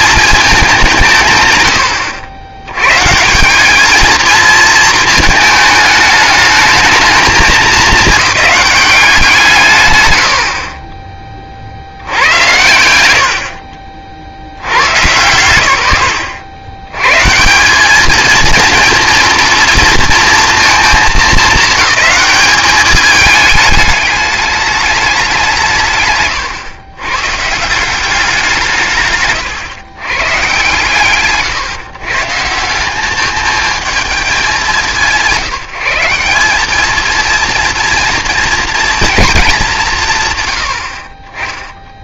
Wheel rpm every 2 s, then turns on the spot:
200, 100, 220, 220, 210, 30, 110, 90, 80, 220, 230, 210, 210, 110, 160, 120, 170, 170, 210, 230, 100.
10-12